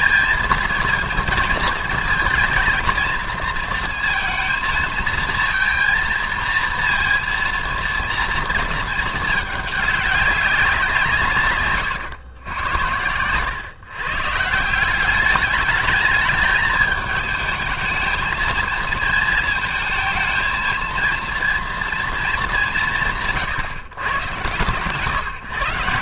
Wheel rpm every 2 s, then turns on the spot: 220, 220, 230, 230, 220, 180, 90, 180, 220, 230, 230, 170, 140.
none